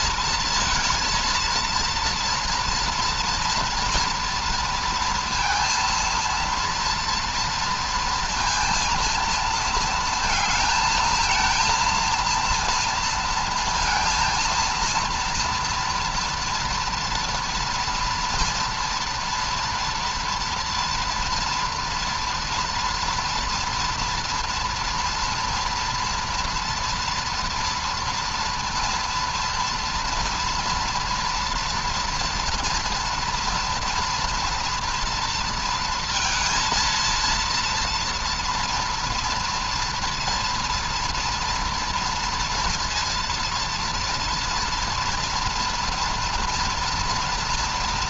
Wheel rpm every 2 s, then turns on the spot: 220, 230, 230, 230, 230, 220, 230, 230, 240, 230, 230, 230, 230, 230, 230, 230, 240, 230, 230, 230, 230, 230, 230, 230.
none